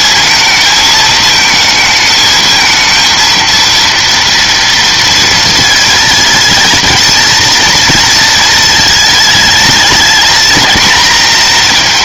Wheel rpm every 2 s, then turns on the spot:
220, 220, 230, 230, 220, 220.
none